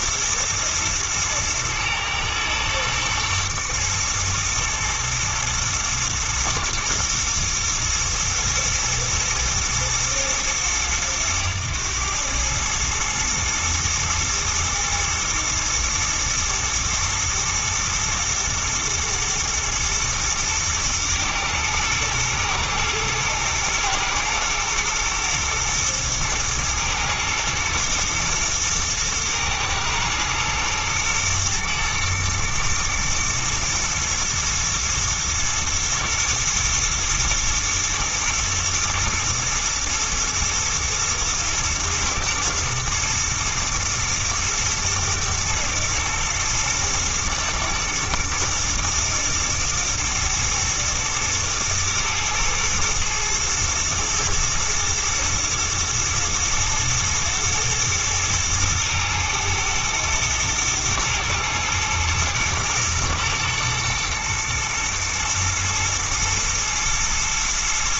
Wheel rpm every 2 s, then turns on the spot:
120, 120, 110, 120, 110, 110, 110, 110, 110, 120, 110, 120, 110, 110, 110, 110, 120, 110, 110, 120, 120, 110, 120, 120, 120, 110, 110, 120, 110, 110, 110, 110, 110, 110.
none